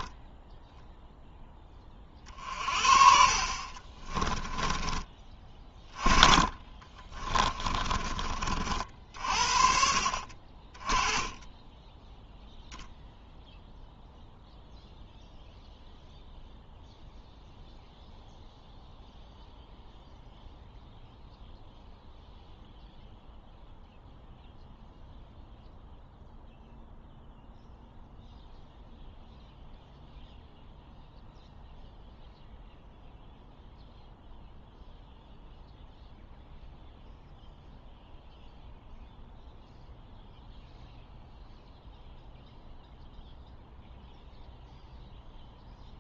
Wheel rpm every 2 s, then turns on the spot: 0, 40, 20, 30, 50, 20, 0, 0, 0, 0, 0, 0, 0, 0, 0, 0, 0, 0, 0, 0, 0, 0, 0.
6-8